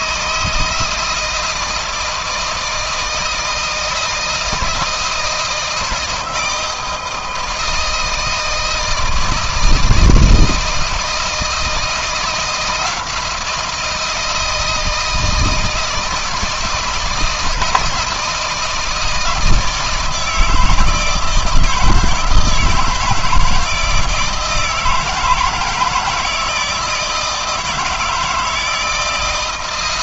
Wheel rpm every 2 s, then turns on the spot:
160, 160, 160, 160, 160, 160, 170, 160, 170, 160, 160, 160, 160, 160, 160.
none